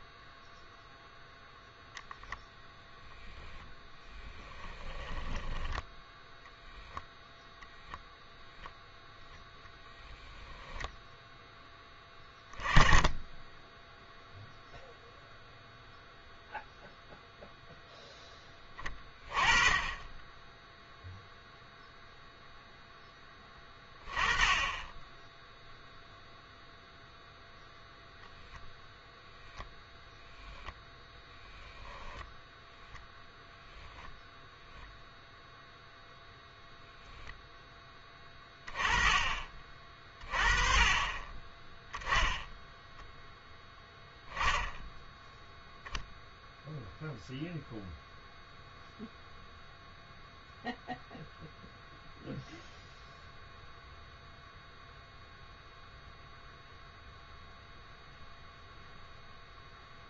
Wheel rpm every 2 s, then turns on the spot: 0, 0, 10, 0, 0, 0, 20, 0, 0, 10, 10, 0, 20, 0, 0, 0, 0, 0, 0, 20, 30, 0, 10, 0, 0, 0, 0, 0, 0, 0.
4-6